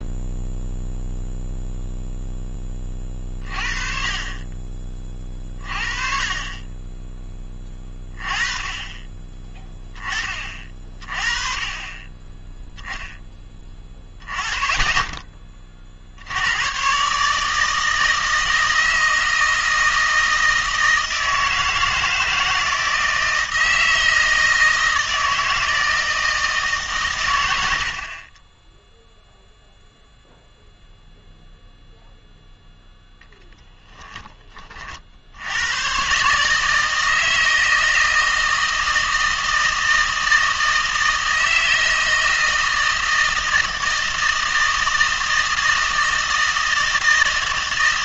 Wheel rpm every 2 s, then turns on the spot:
0, 10, 30, 30, 20, 30, 10, 10, 100, 160, 160, 160, 160, 160, 20, 0, 0, 20, 150, 160, 160, 160, 160, 160.
none